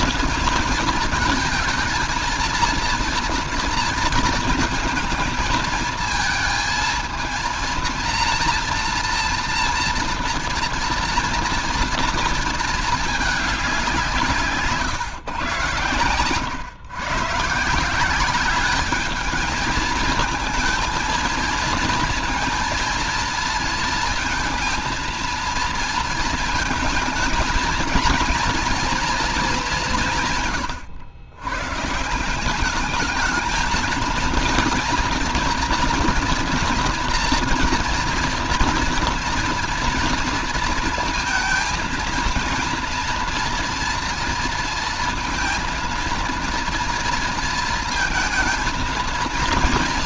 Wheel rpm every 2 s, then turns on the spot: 230, 230, 230, 230, 230, 230, 220, 150, 120, 200, 220, 230, 230, 230, 240, 140, 190, 230, 230, 230, 230, 230, 230, 230, 230.
none